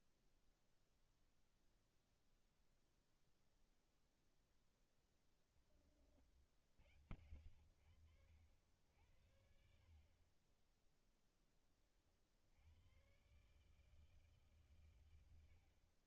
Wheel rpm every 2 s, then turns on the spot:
0, 0, 0, 60, 80, 20, 100, 140.
none